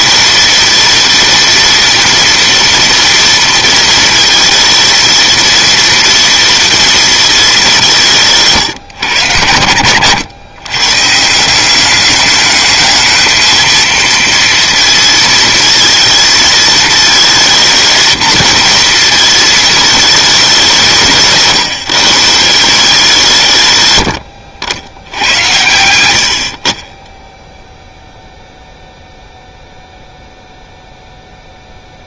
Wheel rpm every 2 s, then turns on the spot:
230, 230, 230, 230, 130, 110, 220, 230, 230, 230, 190, 170, 80, 50, 0, 0.
none